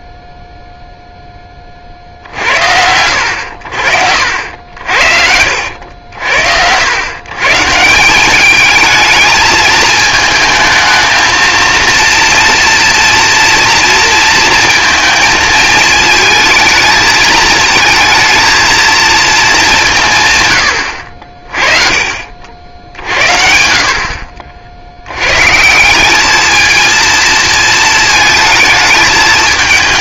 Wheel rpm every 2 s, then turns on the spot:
0, 60, 70, 70, 190, 220, 230, 230, 220, 220, 140, 50, 60, 210, 220.
none